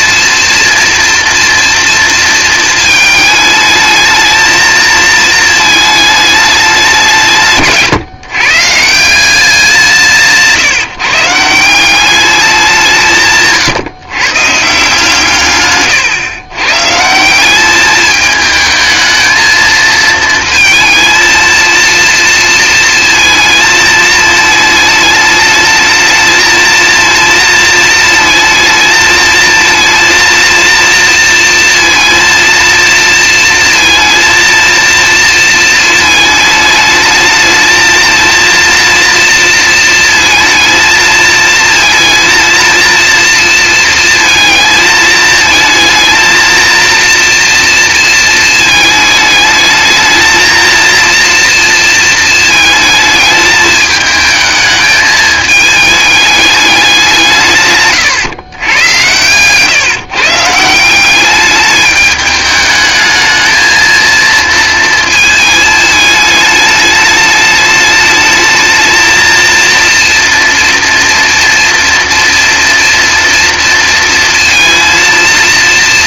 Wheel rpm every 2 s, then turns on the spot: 230, 220, 220, 200, 160, 150, 180, 160, 130, 220, 230, 230, 220, 230, 220, 230, 230, 230, 220, 230, 230, 230, 220, 230, 220, 230, 220, 220, 190, 110, 160, 210, 230, 210, 220, 230, 240, 230.
none